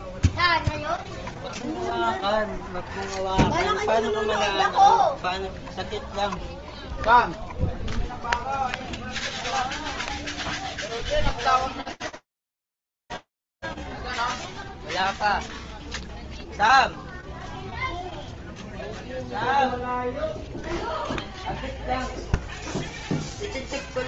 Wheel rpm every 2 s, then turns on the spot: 0, 0, 0, 0, 0, 0, 0, 0, 0, 0, 0, 0.
none